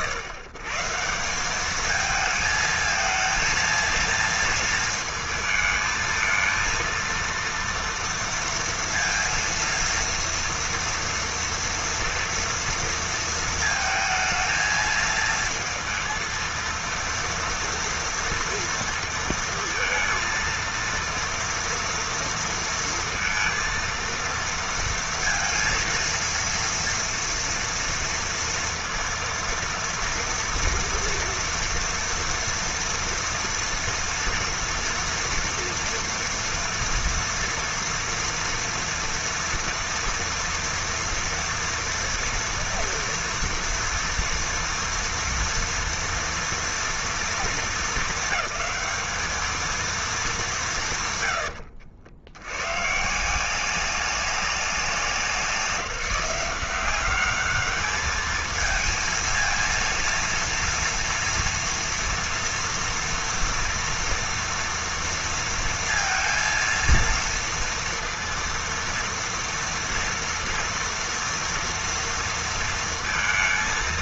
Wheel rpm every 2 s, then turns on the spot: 120, 220, 230, 230, 230, 230, 230, 220, 230, 230, 230, 230, 230, 230, 230, 230, 230, 230, 230, 230, 230, 230, 230, 240, 210, 140, 140, 190, 190, 230, 240, 230, 230, 230, 230, 230, 230.
none